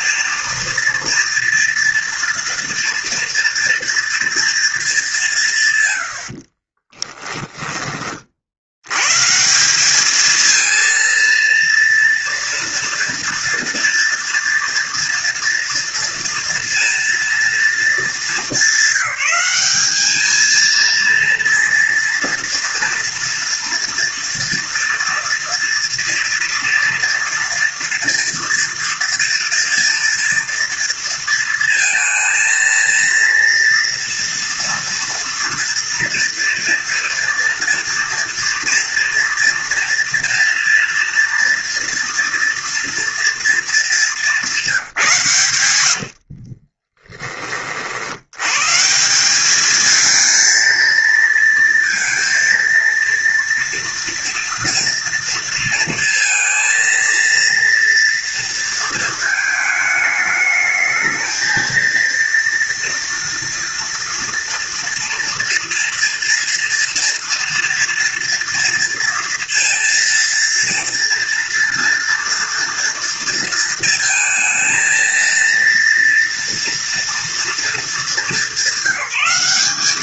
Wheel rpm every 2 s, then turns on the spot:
230, 230, 210, 30, 110, 230, 240, 230, 230, 200, 230, 230, 230, 230, 230, 230, 230, 230, 230, 240, 240, 240, 170, 20, 160, 230, 230, 230, 230, 230, 220, 230, 230, 230, 230, 230, 230, 230, 230, 200.
6-8 46-48